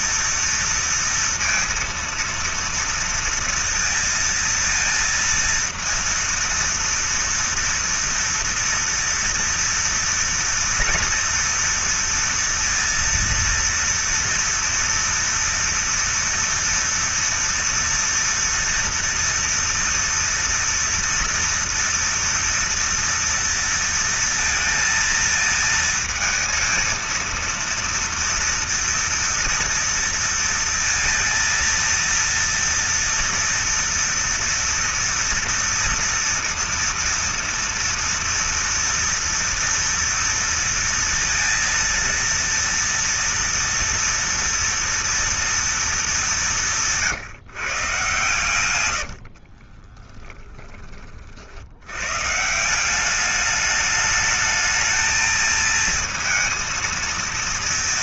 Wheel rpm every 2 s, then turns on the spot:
230, 230, 230, 230, 230, 230, 230, 230, 230, 230, 230, 230, 230, 220, 230, 230, 230, 230, 230, 230, 230, 230, 230, 210, 130, 20, 120, 210, 230.
50-52